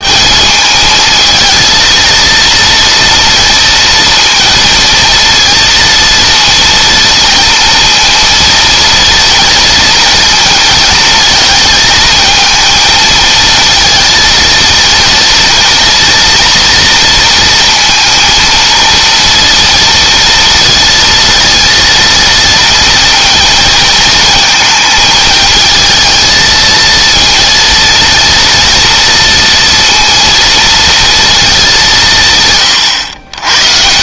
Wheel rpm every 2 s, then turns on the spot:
220, 230, 230, 230, 230, 220, 230, 230, 230, 230, 230, 230, 230, 230, 230, 230, 120.
none